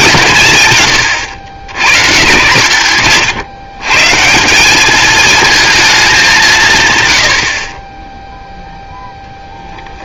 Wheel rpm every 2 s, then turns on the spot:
130, 130, 200, 140, 0.
none